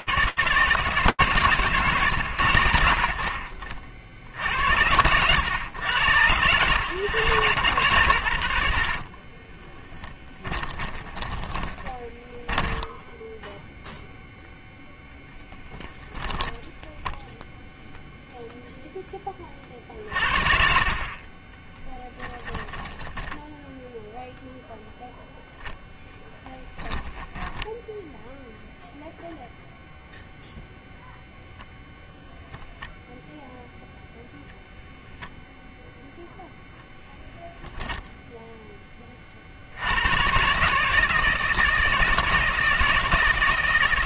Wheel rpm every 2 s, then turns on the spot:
150, 90, 90, 120, 60, 20, 10, 0, 0, 30, 20, 0, 10, 10, 0, 0, 0, 0, 0, 40, 160, 160.
8-14 26-28